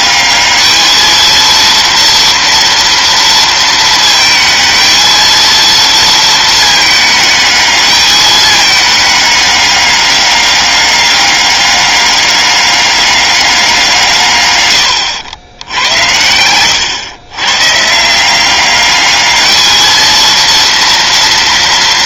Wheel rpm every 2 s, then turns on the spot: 210, 230, 220, 220, 210, 200, 200, 120, 100, 190, 230.
none